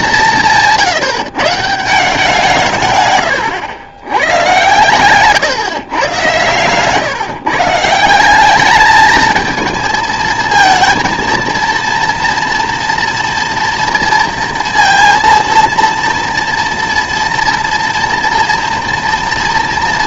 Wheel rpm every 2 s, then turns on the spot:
180, 160, 110, 130, 200, 230, 230, 230, 230, 230.
none